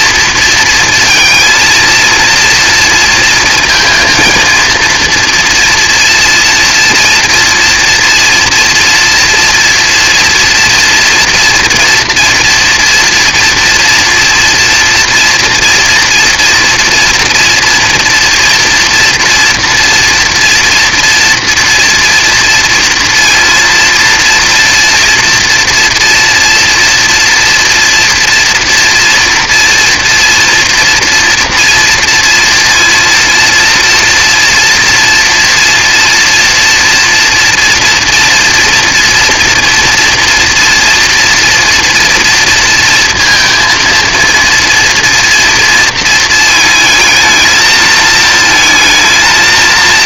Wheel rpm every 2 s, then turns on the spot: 230, 230, 230, 230, 230, 230, 230, 240, 230, 230, 240, 230, 230, 240, 230, 240, 230, 240, 230, 230, 230, 230, 230, 220, 220.
none